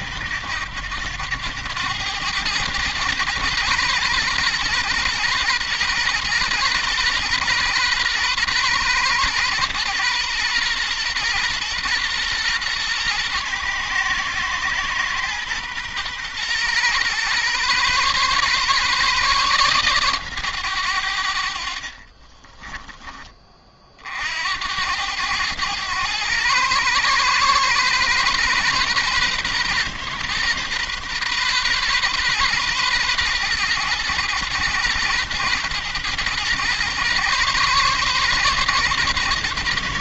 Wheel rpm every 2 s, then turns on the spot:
90, 110, 120, 120, 120, 120, 120, 120, 120, 140, 110, 20, 80, 120, 130, 130, 120, 120, 120, 130.
22-24